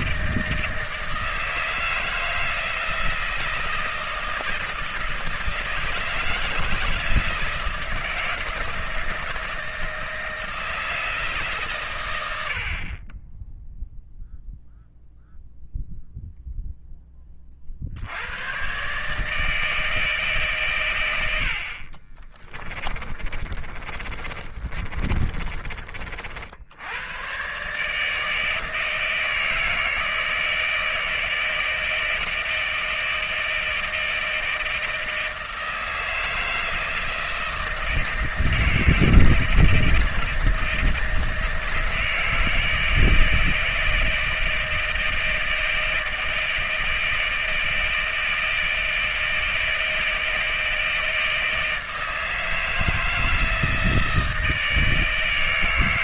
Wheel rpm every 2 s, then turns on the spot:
160, 160, 160, 160, 160, 160, 30, 0, 10, 140, 100, 30, 30, 100, 160, 160, 160, 160, 160, 160, 160, 160, 160, 160, 160, 160, 160, 160.
22-26